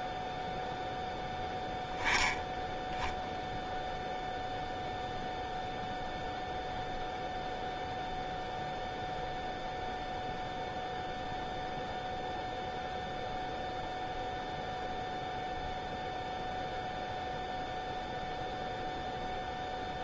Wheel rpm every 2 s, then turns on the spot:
10, 0, 0, 0, 0, 0, 0, 0, 0, 0.
none